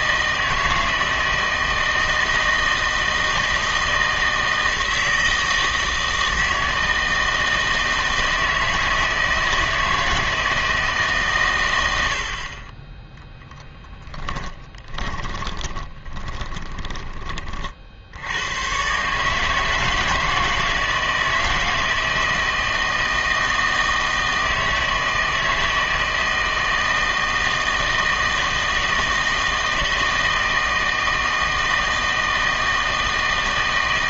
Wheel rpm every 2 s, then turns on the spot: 160, 160, 160, 160, 160, 160, 30, 10, 20, 100, 160, 160, 160, 160, 160, 160, 160.
14-18